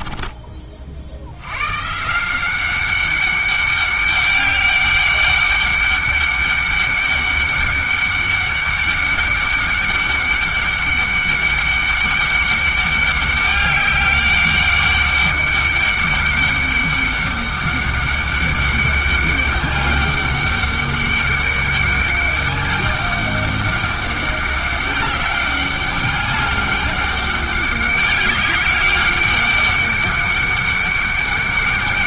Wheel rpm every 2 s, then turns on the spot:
50, 190, 200, 200, 200, 200, 200, 200, 200, 200, 200, 200, 200, 200, 190, 200.
none